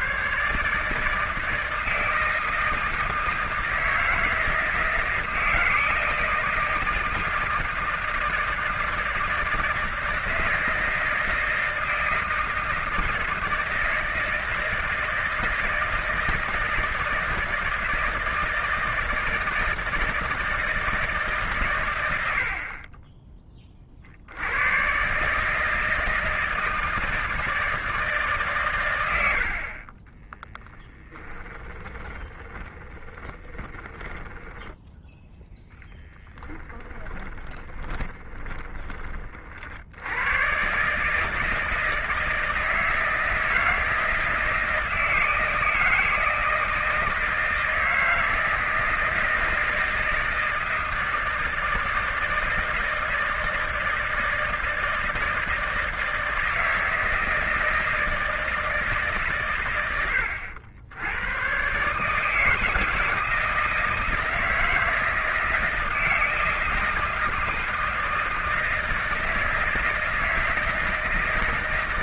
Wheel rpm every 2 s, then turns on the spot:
160, 160, 160, 160, 160, 160, 160, 160, 160, 160, 130, 30, 150, 160, 50, 20, 20, 0, 20, 40, 150, 160, 160, 160, 160, 160, 160, 160, 160, 140, 90, 160, 160, 160, 160, 160.
30-34 36-38